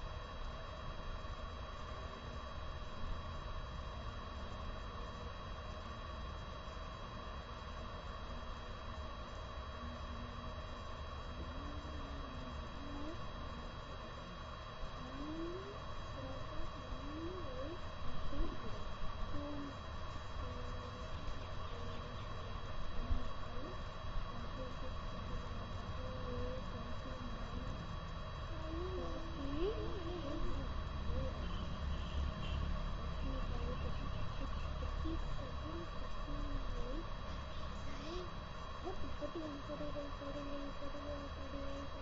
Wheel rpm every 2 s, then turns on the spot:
0, 0, 0, 0, 0, 0, 0, 0, 0, 0, 0, 0, 0, 0, 0, 0, 0, 0, 0, 0, 0.
none